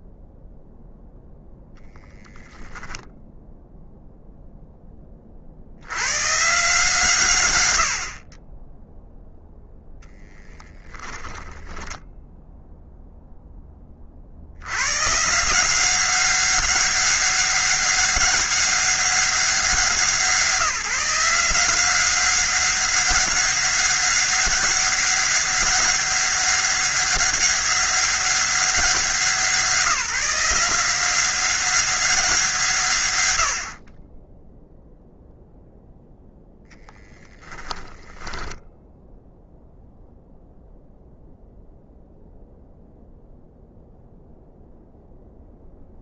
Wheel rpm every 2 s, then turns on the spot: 0, 0, 0, 150, 20, 10, 0, 80, 190, 200, 170, 190, 190, 190, 190, 180, 160, 0, 0, 10, 0, 0, 0.
none